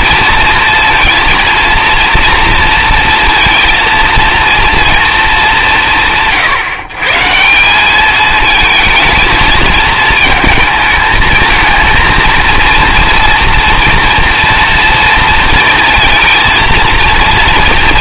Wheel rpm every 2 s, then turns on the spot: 230, 230, 230, 120, 220, 220, 230, 230, 230.
none